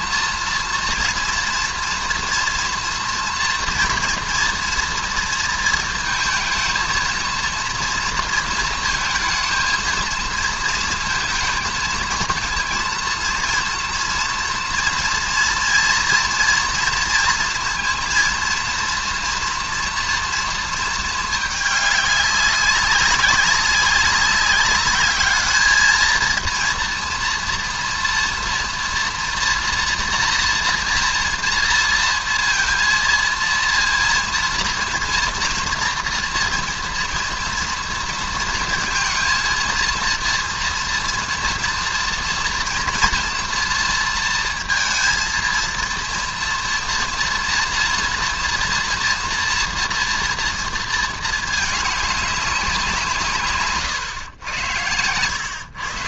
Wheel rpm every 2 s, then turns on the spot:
230, 230, 230, 220, 230, 230, 230, 230, 240, 230, 230, 200, 200, 230, 230, 230, 230, 230, 230, 230, 230, 230, 230, 230, 230, 230, 200, 110.
none